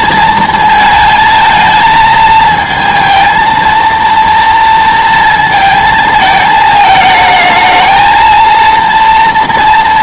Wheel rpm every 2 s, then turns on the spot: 220, 220, 230, 220, 230.
none